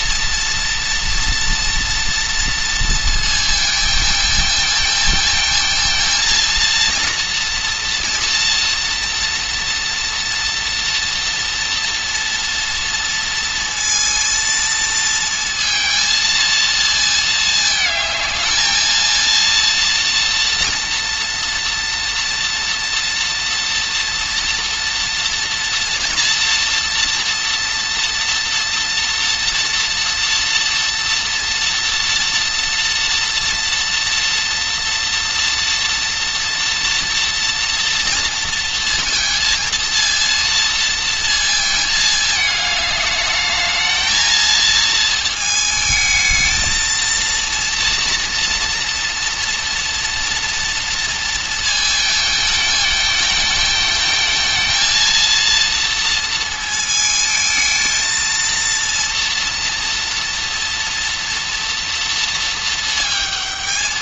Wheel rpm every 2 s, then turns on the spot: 230, 230, 220, 230, 240, 230, 230, 230, 230, 220, 230, 240, 230, 230, 230, 230, 230, 230, 230, 230, 230, 210, 230, 220, 230, 230, 220, 220, 230, 230, 230, 220.
none